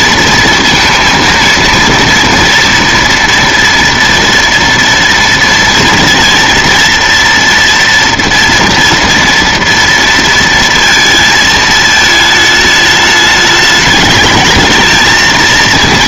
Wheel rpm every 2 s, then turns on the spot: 230, 230, 230, 230, 230, 230, 210, 220.
none